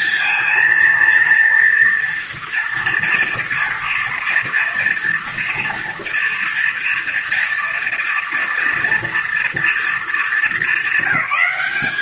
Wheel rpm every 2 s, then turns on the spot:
230, 230, 230, 240, 230, 210.
none